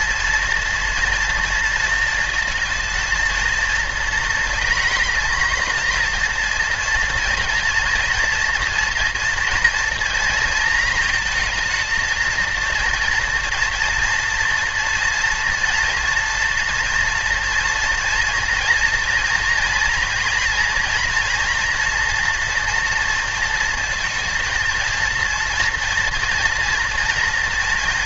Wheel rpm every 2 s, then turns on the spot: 230, 230, 230, 230, 230, 230, 230, 240, 230, 230, 230, 240, 230, 230.
none